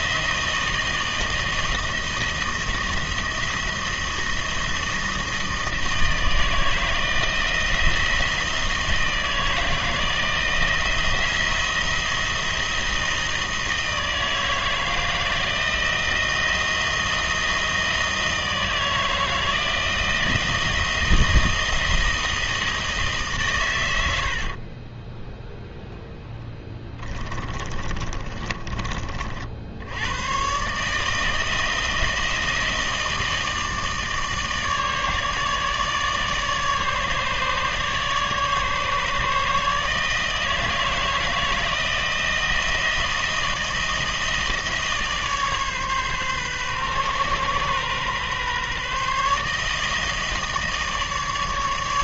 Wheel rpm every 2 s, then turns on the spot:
160, 170, 160, 160, 160, 170, 160, 160, 170, 160, 170, 150, 10, 20, 40, 150, 160, 150, 150, 150, 160, 160, 150, 130, 150, 150.
24-28